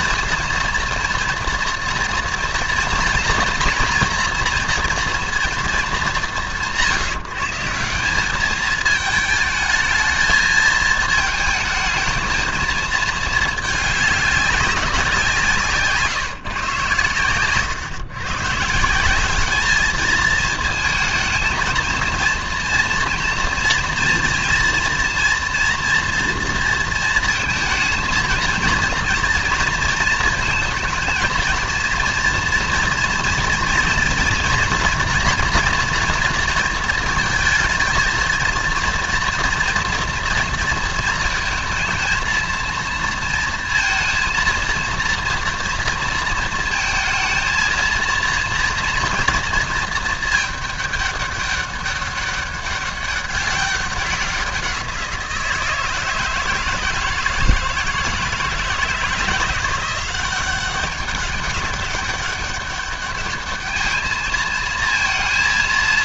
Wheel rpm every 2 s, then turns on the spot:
230, 230, 230, 180, 210, 220, 220, 190, 130, 160, 220, 230, 230, 230, 230, 220, 240, 240, 230, 230, 230, 230, 230, 230, 230, 210, 200, 180, 170, 160, 190, 200, 220.
none